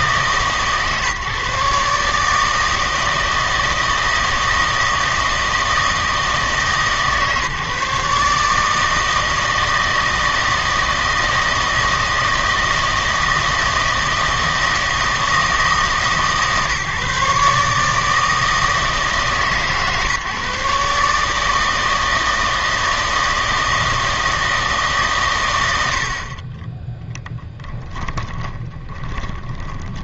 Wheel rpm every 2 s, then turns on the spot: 150, 160, 160, 150, 150, 160, 160, 160, 150, 160, 140, 160, 160, 20, 20.
28-30